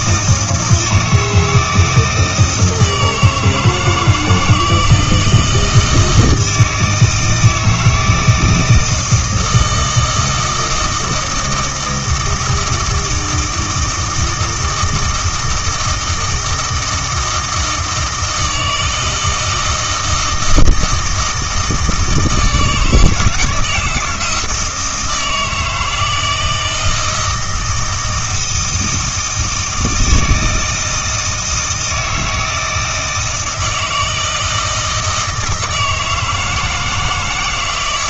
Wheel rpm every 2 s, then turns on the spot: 160, 160, 160, 160, 160, 160, 160, 160, 160, 160, 160, 160, 160, 160, 160, 160, 160, 160, 160.
none